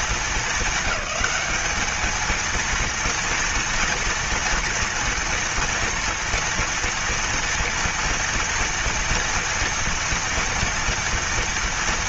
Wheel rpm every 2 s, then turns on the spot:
200, 230, 230, 230, 240, 230.
none